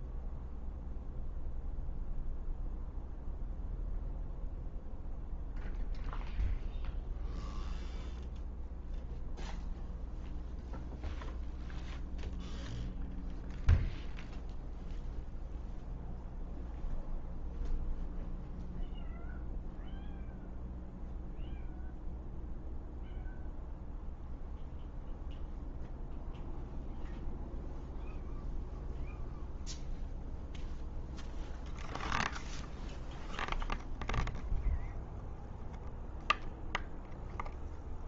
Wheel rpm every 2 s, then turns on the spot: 0, 0, 0, 0, 0, 0, 0, 0, 0, 0, 0, 0, 0, 0, 0, 0, 0, 0, 0.
none